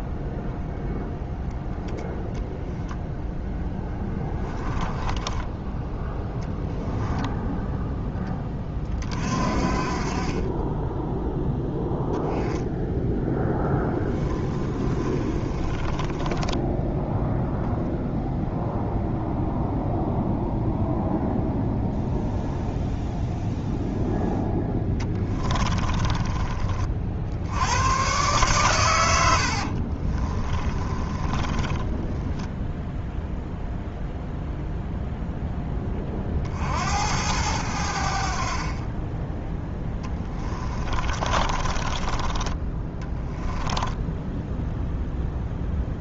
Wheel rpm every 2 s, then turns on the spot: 0, 0, 20, 0, 30, 10, 10, 20, 10, 0, 0, 0, 10, 40, 90, 20, 0, 0, 80, 20, 20, 10, 0.
4-6 14-18 24-26 30-32 40-44